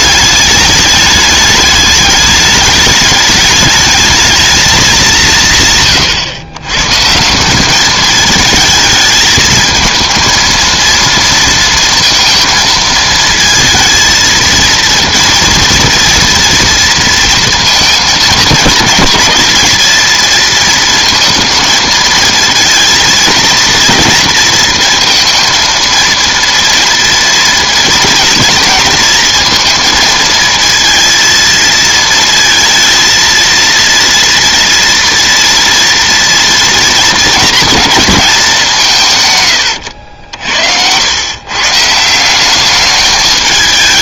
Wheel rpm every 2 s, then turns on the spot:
210, 210, 220, 130, 220, 230, 220, 230, 230, 210, 230, 230, 230, 230, 230, 230, 230, 230, 230, 170, 90, 200.
none